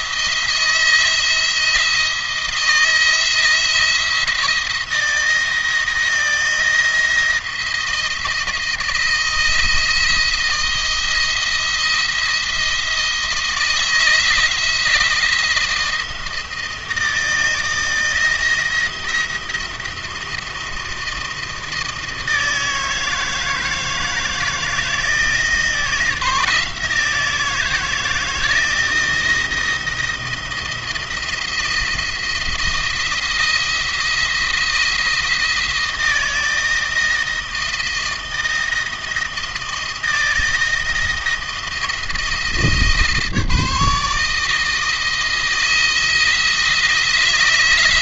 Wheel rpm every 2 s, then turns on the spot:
170, 170, 170, 160, 170, 160, 160, 160, 160, 170, 170, 160, 160, 160, 160, 170, 170, 170, 160, 160, 160, 160, 160, 170.
none